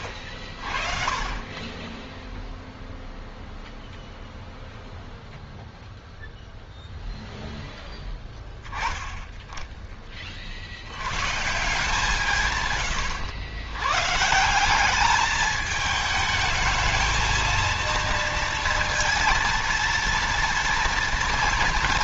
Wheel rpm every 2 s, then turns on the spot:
30, 0, 0, 0, 10, 90, 120, 200, 220, 230, 230.
none